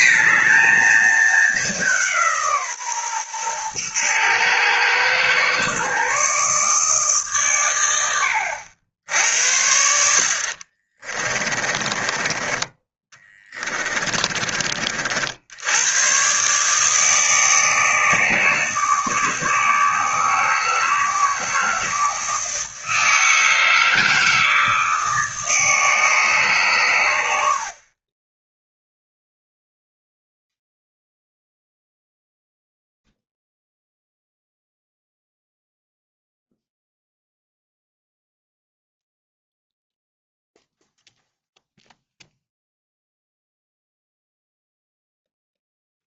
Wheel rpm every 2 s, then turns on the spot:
230, 140, 120, 150, 80, 30, 20, 50, 150, 160, 160, 160, 160, 120, 0, 0, 0, 0, 0, 0, 0, 0, 0.
10-12